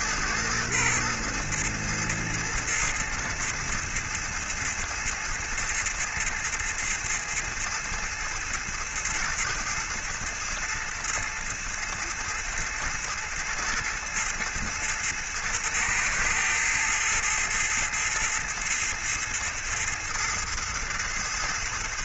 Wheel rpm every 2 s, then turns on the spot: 110, 110, 110, 110, 110, 110, 110, 110, 110, 110, 110.
none